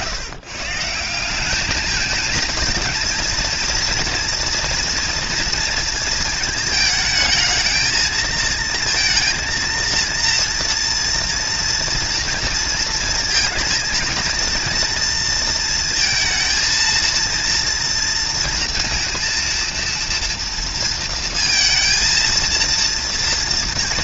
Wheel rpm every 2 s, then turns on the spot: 170, 230, 230, 220, 230, 240, 230, 230, 230, 230, 230, 230.
none